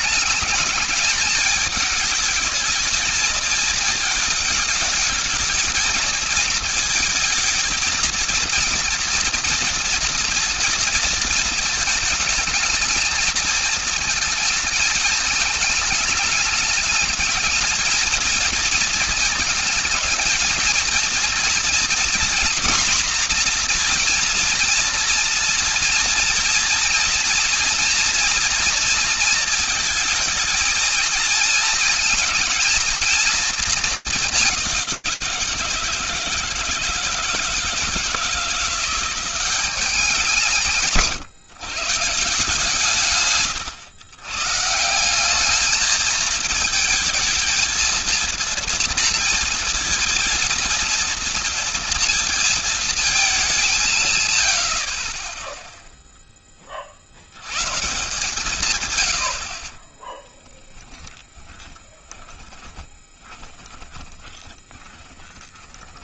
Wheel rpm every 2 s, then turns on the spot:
210, 220, 220, 220, 230, 230, 220, 220, 210, 230, 230, 240, 230, 240, 230, 220, 230, 180, 170, 180, 160, 140, 180, 220, 230, 230, 220, 40, 100, 70, 10, 20, 10.
60-66